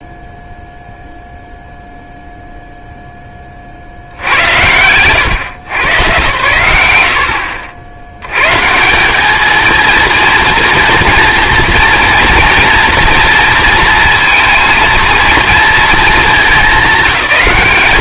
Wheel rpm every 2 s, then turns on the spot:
0, 0, 100, 80, 140, 230, 230, 230, 200.
none